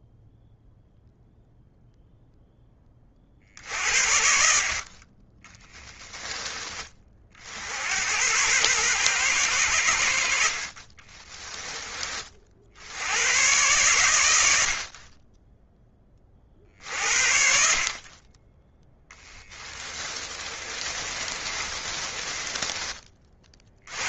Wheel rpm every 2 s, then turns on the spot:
0, 20, 50, 30, 120, 40, 70, 50, 50, 10, 30, 30.
20-22